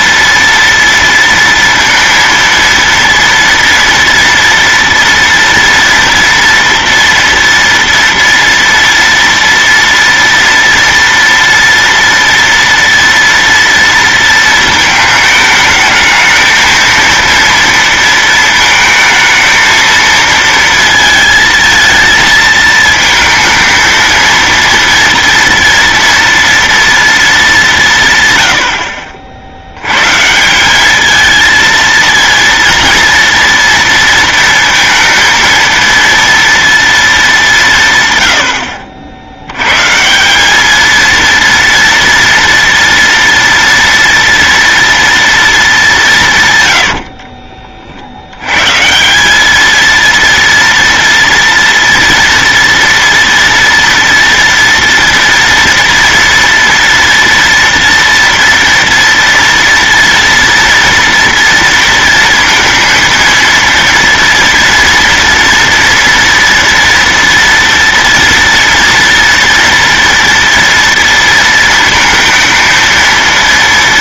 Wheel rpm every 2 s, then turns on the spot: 230, 230, 230, 230, 230, 230, 230, 220, 230, 220, 230, 220, 230, 240, 80, 200, 230, 230, 230, 70, 220, 230, 240, 90, 140, 230, 240, 230, 230, 230, 230, 230, 230, 230, 230, 230, 230.
46-48